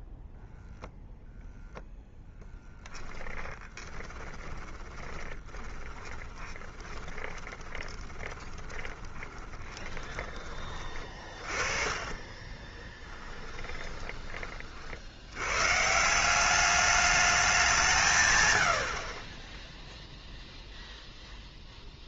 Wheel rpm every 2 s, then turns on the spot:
0, 10, 20, 20, 20, 30, 20, 40, 200, 80, 0.
2-14